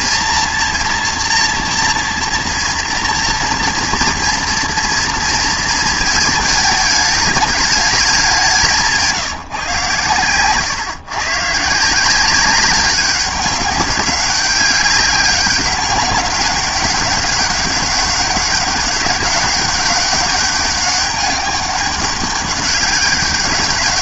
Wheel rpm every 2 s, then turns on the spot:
230, 230, 230, 220, 180, 130, 190, 190, 200, 190, 200, 200.
none